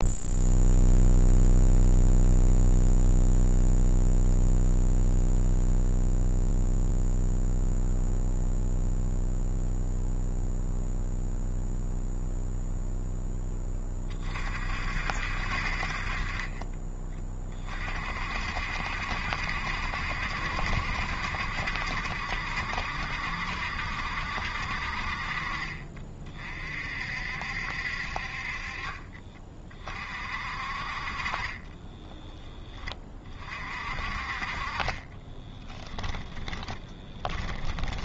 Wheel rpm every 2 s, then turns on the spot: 0, 0, 0, 0, 0, 0, 0, 60, 20, 60, 60, 70, 50, 50, 30, 40, 20, 30, 20.
28-30 34-38